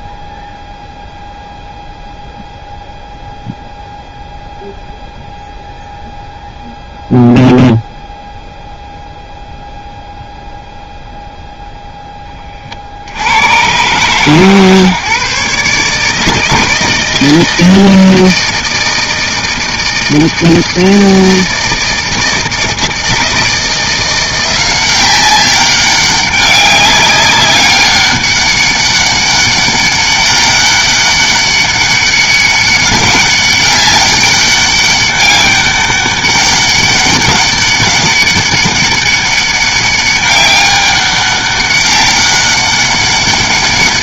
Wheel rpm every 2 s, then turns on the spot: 0, 0, 0, 0, 0, 0, 100, 140, 160, 160, 160, 160, 190, 200, 200, 200, 200, 200, 200, 200, 200, 180.
none